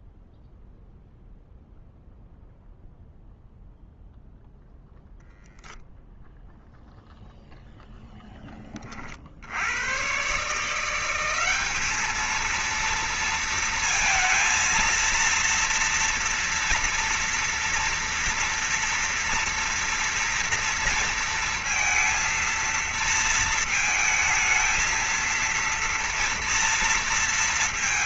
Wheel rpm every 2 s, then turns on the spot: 0, 0, 0, 0, 0, 100, 210, 230, 230, 230, 230, 230, 220, 230.
none